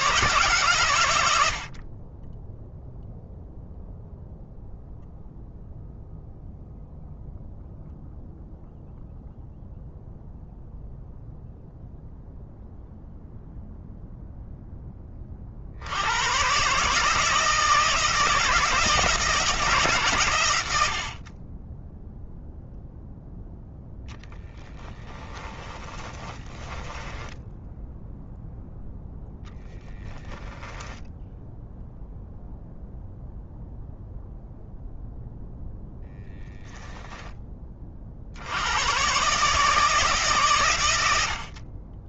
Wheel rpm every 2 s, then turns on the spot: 120, 0, 0, 0, 0, 0, 0, 20, 140, 160, 70, 0, 20, 10, 0, 10, 0, 0, 10, 120, 100.
24-28